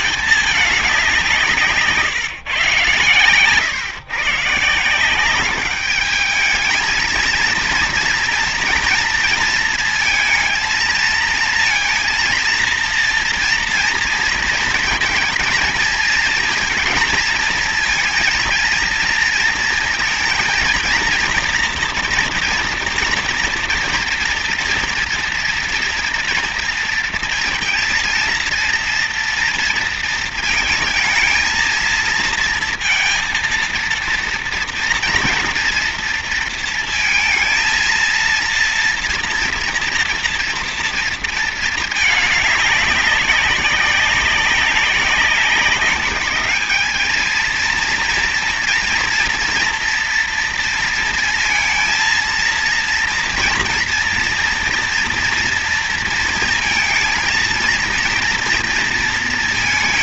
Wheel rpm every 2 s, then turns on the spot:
210, 130, 160, 210, 230, 220, 230, 230, 230, 230, 230, 230, 230, 240, 230, 230, 230, 230, 230, 230, 230, 210, 200, 210, 230, 230, 230, 230, 230, 230.
none